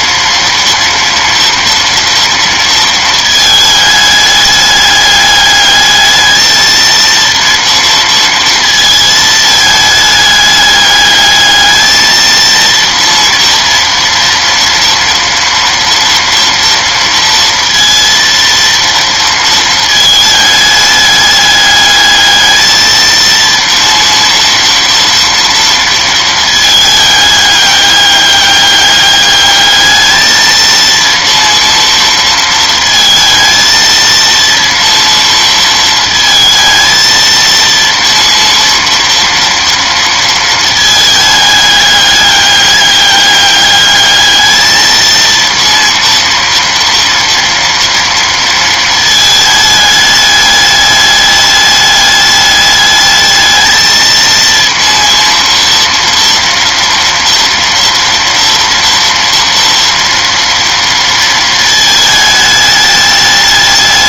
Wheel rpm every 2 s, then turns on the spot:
230, 230, 210, 220, 230, 210, 230, 230, 230, 230, 210, 220, 230, 220, 200, 220, 230, 230, 230, 230, 230, 200, 220, 230, 230, 210, 210, 230, 230, 230, 230, 210.
none